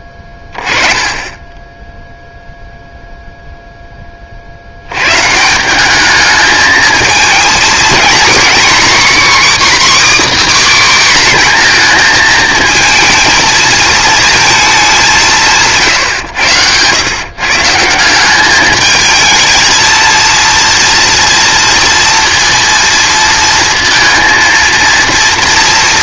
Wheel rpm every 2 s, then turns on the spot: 10, 0, 100, 220, 270, 280, 220, 210, 110, 210, 230, 230, 230.
none